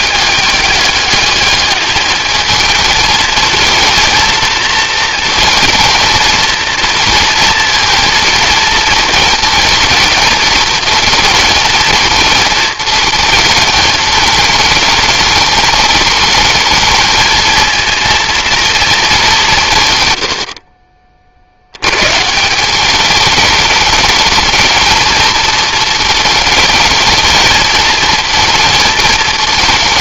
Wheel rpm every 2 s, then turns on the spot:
210, 220, 230, 230, 220, 220, 220, 220, 220, 230, 60, 170, 220, 220, 220.
none